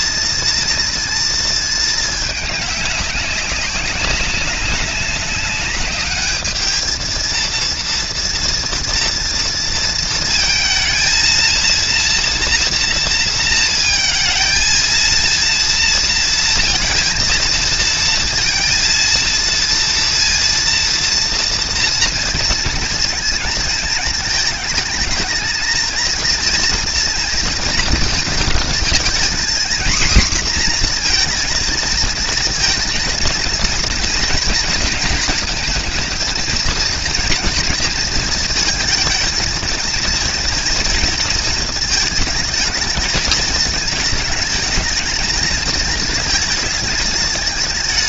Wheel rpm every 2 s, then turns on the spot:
230, 210, 190, 210, 230, 230, 230, 220, 230, 230, 230, 230, 220, 230, 220, 240, 230, 230, 220, 220, 230, 220, 210, 220.
none